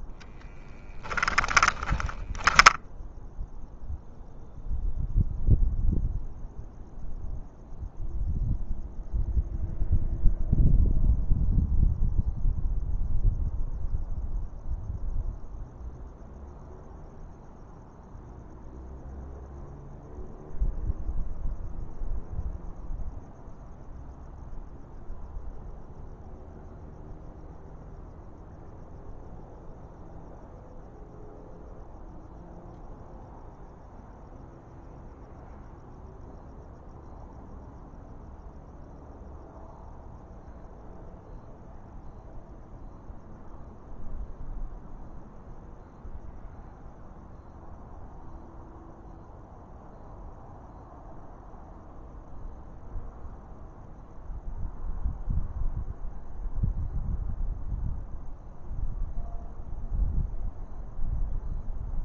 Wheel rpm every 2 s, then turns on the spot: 20, 0, 0, 0, 0, 0, 0, 0, 0, 0, 0, 0, 0, 0, 0, 0, 0, 0, 0, 0, 0, 0, 0, 0, 0, 0, 0, 0, 0, 0, 0.
0-2